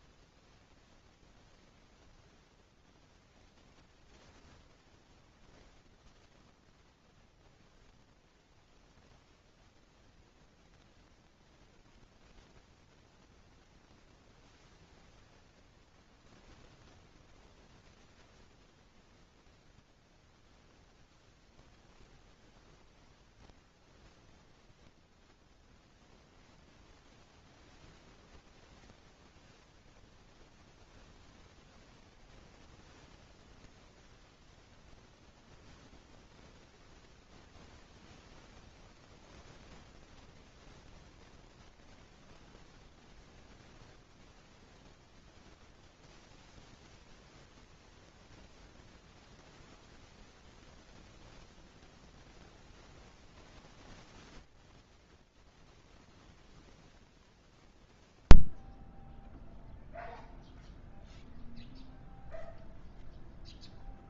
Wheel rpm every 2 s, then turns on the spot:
0, 0, 0, 0, 0, 0, 0, 0, 0, 0, 0, 0, 0, 0, 0, 0, 0, 0, 0, 0, 0, 0, 0, 0, 0, 0, 0, 10, 0, 0, 0, 0.
none